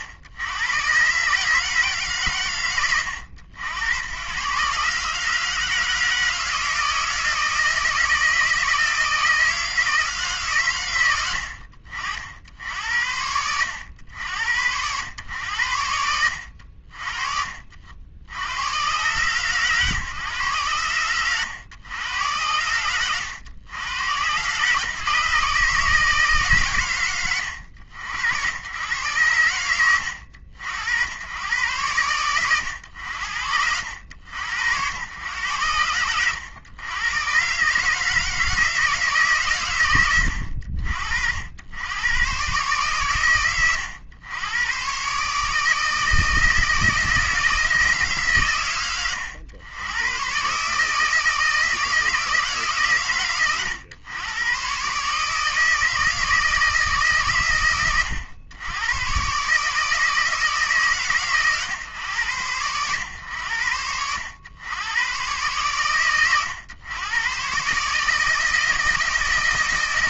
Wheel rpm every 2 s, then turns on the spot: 100, 90, 130, 160, 160, 100, 60, 80, 70, 90, 100, 90, 130, 140, 70, 80, 100, 70, 100, 160, 80, 100, 110, 160, 100, 140, 130, 120, 160, 90, 140, 110, 90, 110, 160.
none